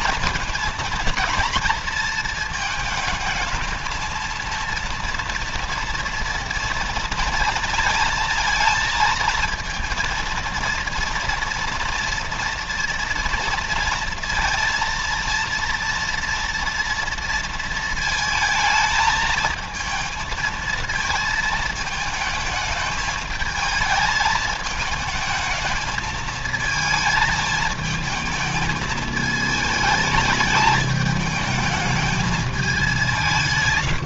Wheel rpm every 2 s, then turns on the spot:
230, 220, 230, 230, 230, 230, 230, 230, 230, 220, 230, 220, 220, 220, 220, 220, 190.
none